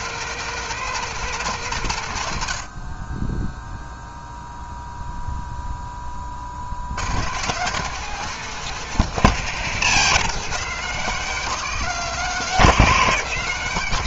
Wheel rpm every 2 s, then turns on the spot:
180, 40, 0, 100, 170, 170, 170.
none